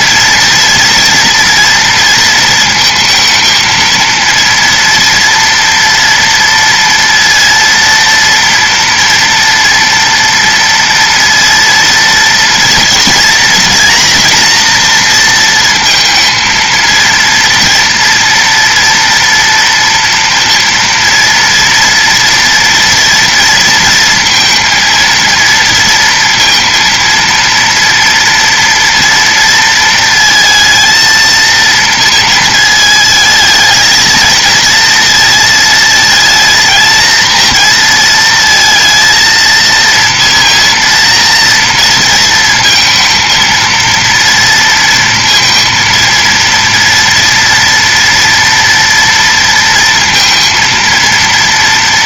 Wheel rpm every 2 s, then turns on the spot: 230, 230, 230, 230, 230, 230, 230, 240, 230, 230, 230, 230, 230, 230, 230, 230, 220, 230, 230, 230, 230, 230, 230, 230, 240, 230.
none